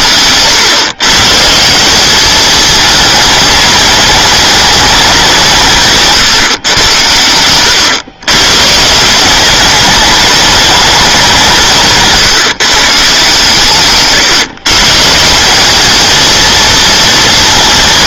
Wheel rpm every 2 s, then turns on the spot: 130, 220, 220, 110, 150, 210, 150, 140, 230.
none